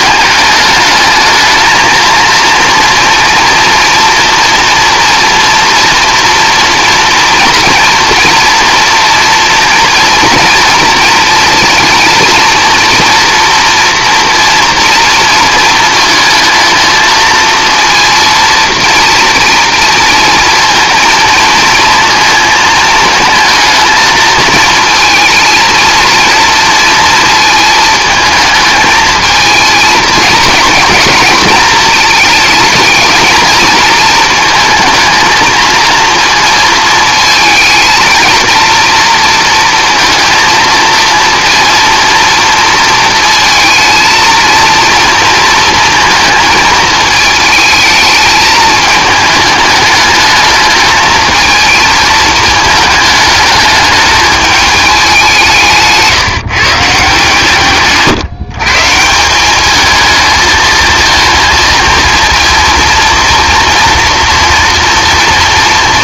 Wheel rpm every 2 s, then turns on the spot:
220, 230, 230, 240, 240, 230, 230, 230, 220, 230, 230, 220, 230, 230, 220, 230, 220, 220, 220, 230, 230, 230, 230, 220, 210, 220, 210, 210, 150, 150, 220, 230, 230.
none